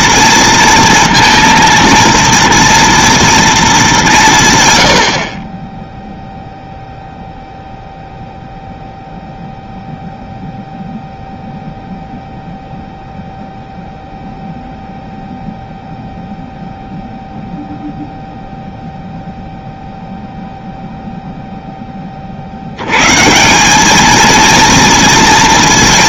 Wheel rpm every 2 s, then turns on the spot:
230, 230, 130, 0, 0, 0, 0, 0, 0, 0, 0, 70, 230.
none